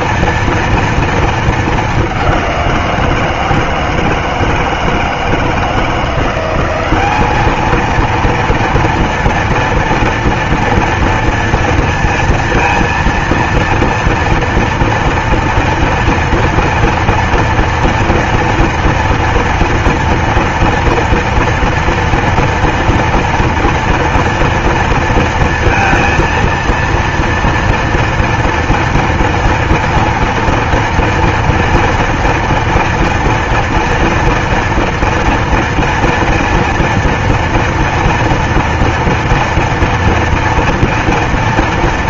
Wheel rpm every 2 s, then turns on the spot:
230, 180, 160, 180, 230, 230, 230, 230, 230, 230, 230, 240, 230, 230, 230, 230, 230, 230, 230, 230, 230.
none